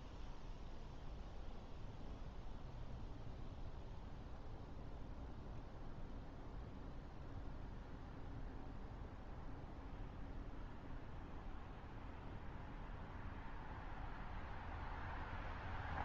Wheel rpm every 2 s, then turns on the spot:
0, 0, 0, 0, 0, 0, 0, 0.
none